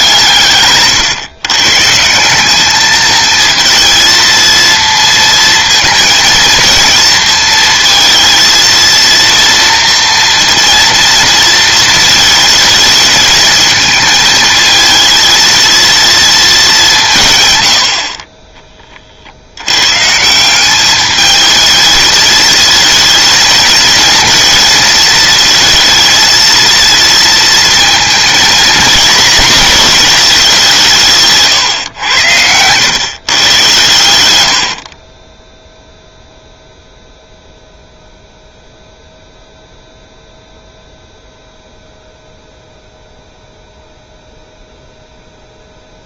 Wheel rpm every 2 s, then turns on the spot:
140, 210, 230, 230, 230, 230, 220, 220, 190, 30, 200, 220, 220, 230, 230, 170, 110, 40, 0, 0, 0, 0, 0.
34-36